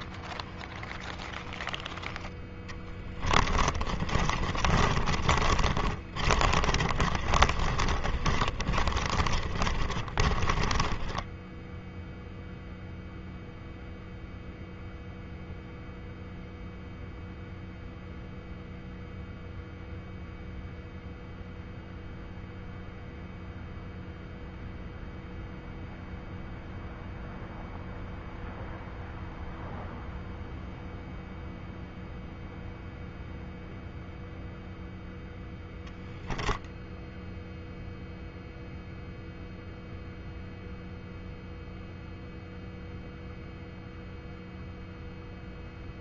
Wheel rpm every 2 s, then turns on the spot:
0, 20, 30, 30, 40, 20, 0, 0, 0, 0, 0, 0, 0, 0, 0, 0, 0, 0, 0, 0, 0, 0, 0.
2-12